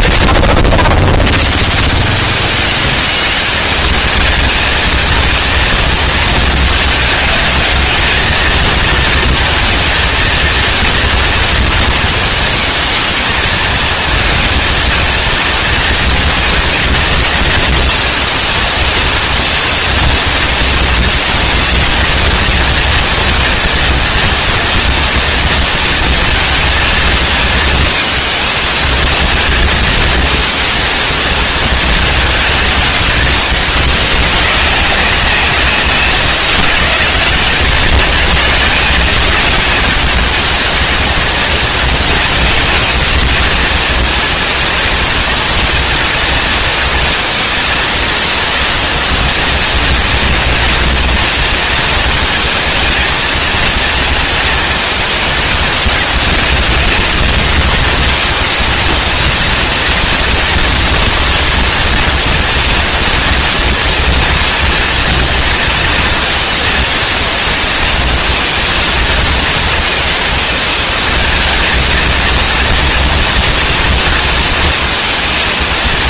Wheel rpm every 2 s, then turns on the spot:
40, 190, 220, 230, 220, 230, 220, 220, 240, 230, 230, 230, 230, 230, 220, 230, 220, 200, 150, 140, 210, 220, 230, 230, 230, 230, 220, 230, 220, 220, 230, 240, 240, 230, 230, 230, 230, 230.
none